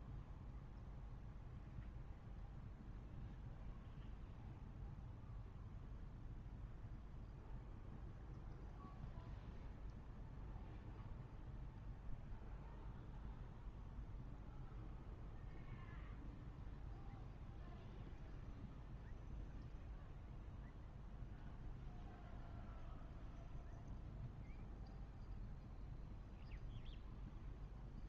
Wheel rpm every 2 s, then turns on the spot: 0, 0, 0, 0, 0, 0, 0, 0, 0, 0, 0, 0, 0, 0.
none